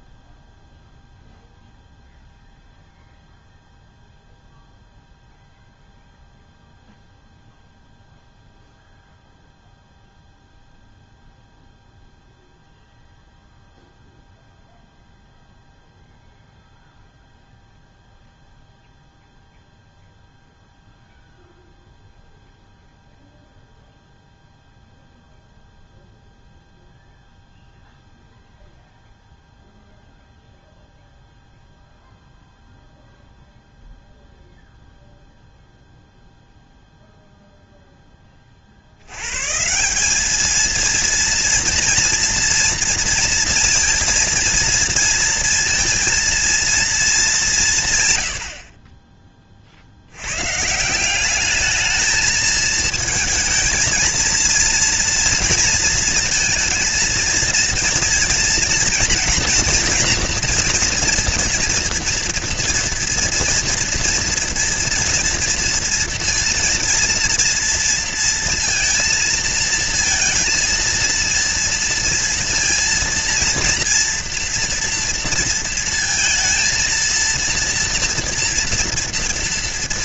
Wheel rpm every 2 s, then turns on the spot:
0, 0, 0, 0, 0, 0, 0, 0, 0, 0, 0, 0, 0, 0, 0, 0, 0, 0, 0, 30, 210, 230, 230, 230, 90, 120, 220, 230, 230, 230, 240, 230, 230, 230, 230, 230, 230, 230, 220, 230.
none